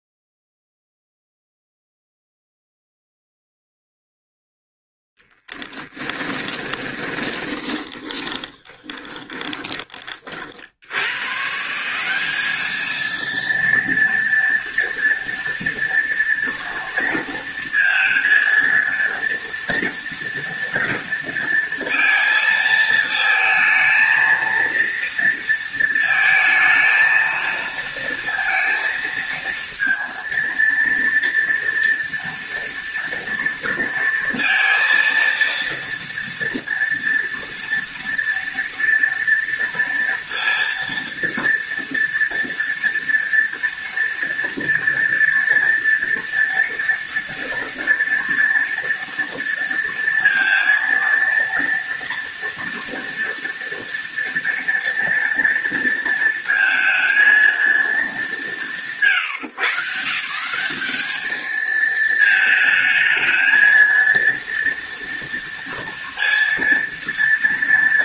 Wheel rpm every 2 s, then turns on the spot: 0, 0, 0, 20, 20, 60, 210, 230, 230, 230, 230, 220, 230, 220, 230, 230, 230, 230, 230, 230, 230, 230, 230, 230, 230, 230, 230, 230, 230, 180, 180, 220, 230, 230.
6-10